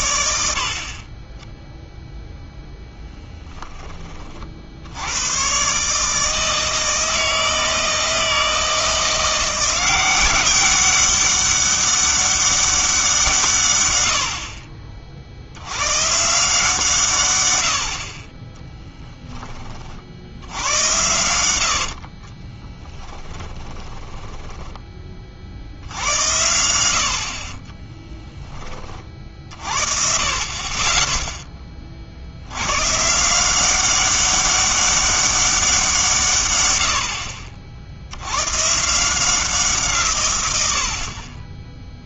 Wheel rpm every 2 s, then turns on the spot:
60, 0, 60, 160, 160, 190, 190, 40, 160, 10, 90, 20, 20, 80, 20, 20, 120, 200, 110, 120, 90.
22-26